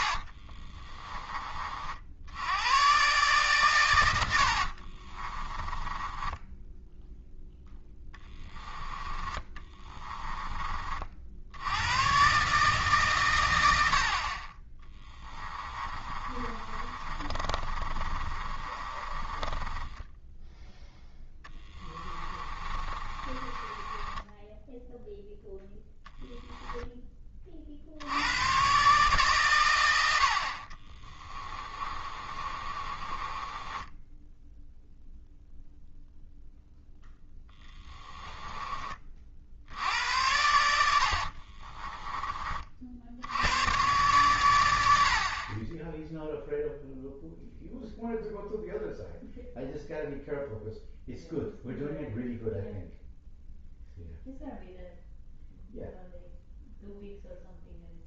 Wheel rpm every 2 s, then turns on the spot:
20, 110, 40, 10, 10, 30, 140, 20, 30, 30, 10, 30, 0, 10, 130, 40, 30, 0, 0, 20, 80, 50, 80, 0, 0, 0, 0, 0, 0.
0-2 4-8 16-20 22-24 30-34